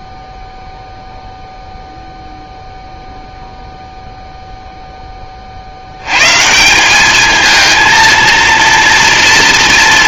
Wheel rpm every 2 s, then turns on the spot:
0, 0, 0, 170, 230.
none